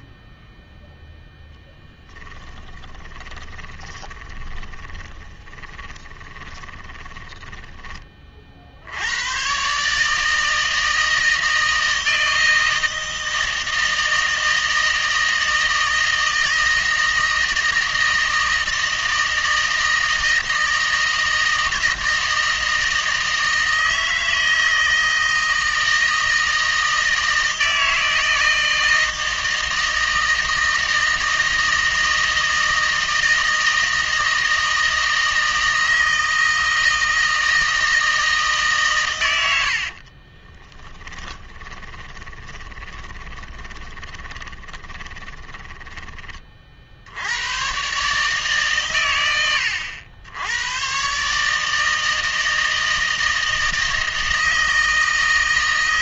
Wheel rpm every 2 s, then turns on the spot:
0, 10, 20, 20, 60, 160, 160, 160, 160, 160, 160, 160, 160, 160, 160, 160, 160, 160, 160, 140, 20, 20, 10, 40, 130, 110, 160, 160.
2-8 40-46